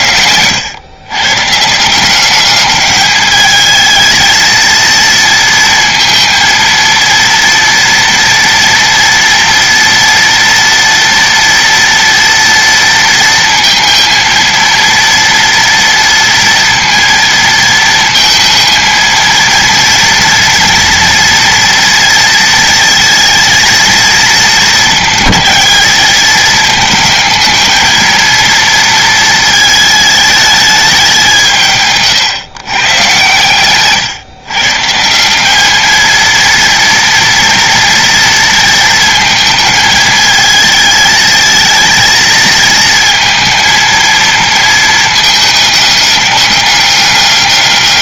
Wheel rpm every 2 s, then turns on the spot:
110, 210, 220, 230, 230, 230, 230, 230, 230, 230, 230, 230, 220, 220, 230, 200, 130, 150, 230, 230, 220, 220, 220, 200.
none